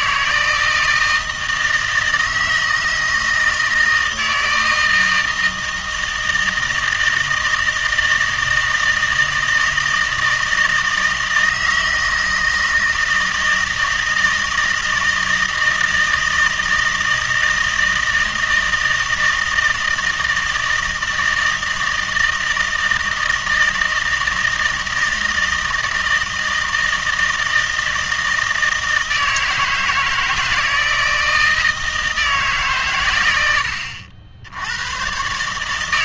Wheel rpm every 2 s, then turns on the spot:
160, 160, 160, 160, 160, 160, 160, 160, 160, 160, 160, 160, 160, 160, 160, 160, 140, 90.
none